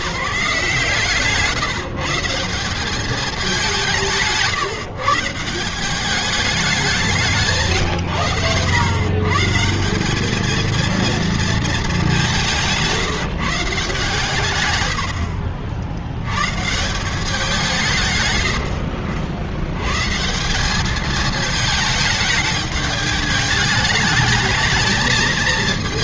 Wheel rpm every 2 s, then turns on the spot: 150, 190, 160, 140, 160, 220, 150, 80, 160, 80, 210, 210, 220.
6-8